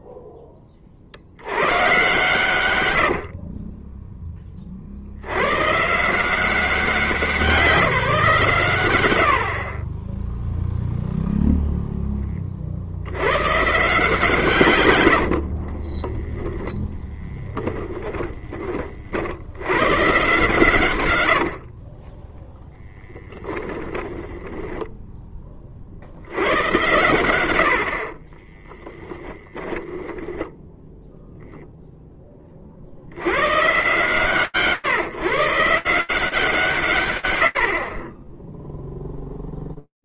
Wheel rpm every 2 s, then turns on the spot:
20, 110, 30, 170, 120, 0, 50, 130, 10, 30, 130, 0, 10, 90, 20, 10, 40, 130, 130, 0.
16-20 24-26 28-30